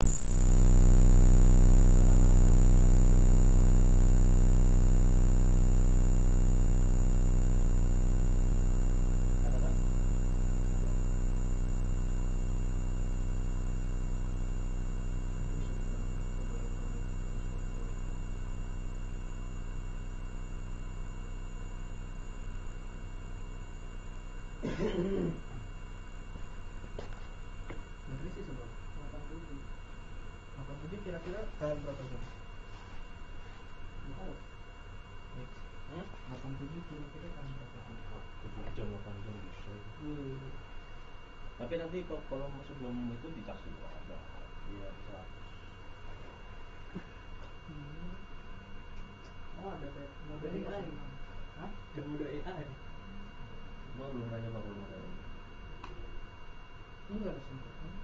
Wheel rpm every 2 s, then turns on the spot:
0, 0, 0, 0, 0, 0, 0, 0, 0, 0, 0, 0, 0, 0, 0, 0, 0, 0, 0, 0, 0, 0, 0, 0, 0, 0, 0, 0, 0.
none